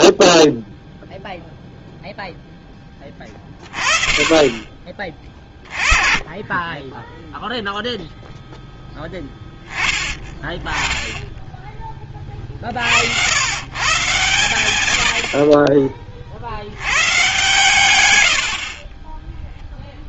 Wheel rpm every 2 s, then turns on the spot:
0, 10, 20, 10, 0, 10, 50, 90, 110, 40.
none